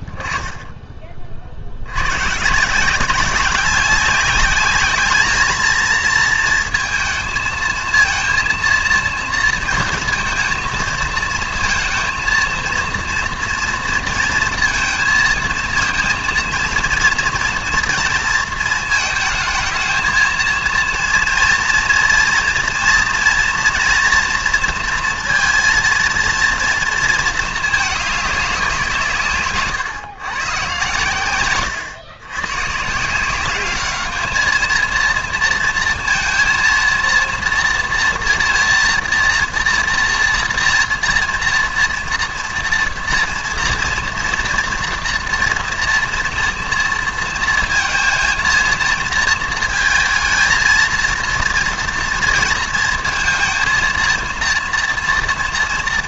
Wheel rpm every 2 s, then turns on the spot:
10, 160, 210, 230, 230, 230, 230, 230, 230, 230, 230, 230, 240, 230, 180, 110, 130, 220, 230, 240, 230, 230, 230, 230, 230, 220, 230, 230.
none